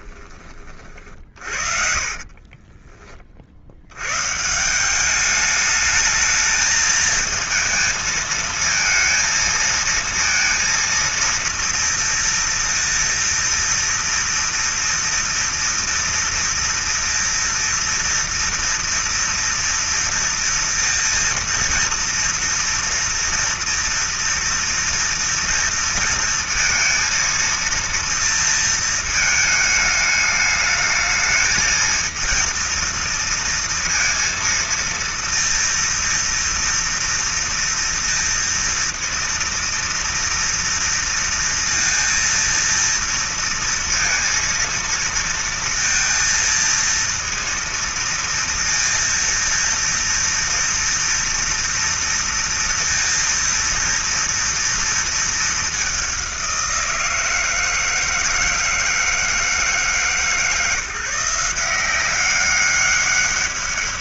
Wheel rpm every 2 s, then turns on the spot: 20, 40, 120, 210, 230, 230, 230, 230, 230, 230, 230, 230, 230, 230, 230, 210, 230, 230, 230, 230, 230, 230, 230, 230, 230, 230, 230, 230, 200, 160, 150, 180.
0-4